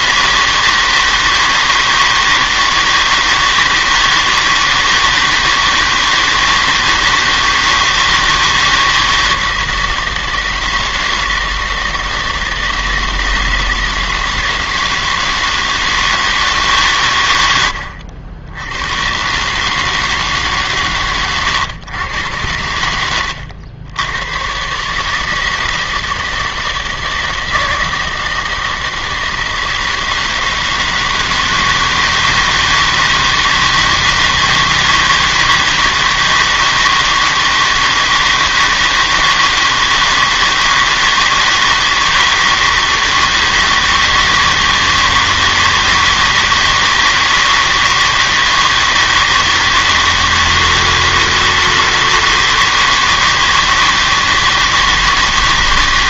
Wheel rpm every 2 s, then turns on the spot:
160, 160, 160, 160, 160, 160, 160, 160, 150, 90, 140, 90, 120, 160, 160, 160, 160, 160, 160, 160, 160, 160, 160, 160, 160, 160, 160, 160.
none